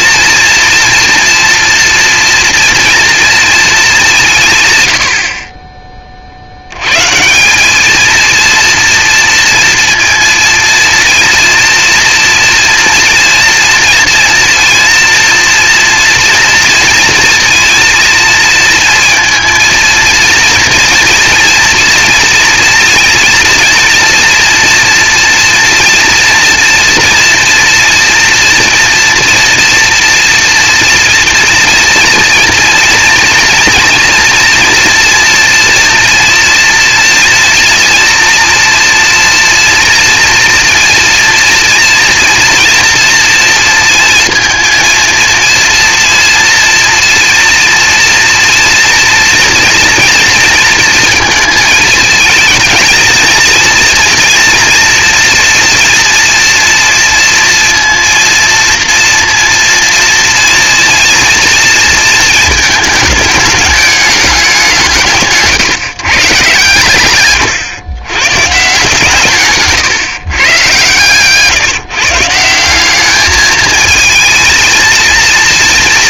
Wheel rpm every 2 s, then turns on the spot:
230, 230, 140, 90, 230, 230, 230, 240, 230, 230, 230, 230, 230, 230, 230, 230, 230, 240, 230, 230, 240, 230, 230, 230, 230, 230, 220, 230, 230, 230, 230, 220, 190, 120, 140, 130, 180, 220.
none